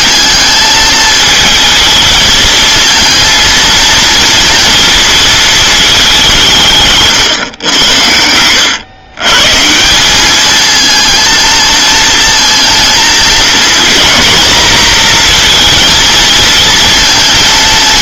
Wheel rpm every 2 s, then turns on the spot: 220, 230, 230, 150, 100, 220, 220, 230, 230.
6-8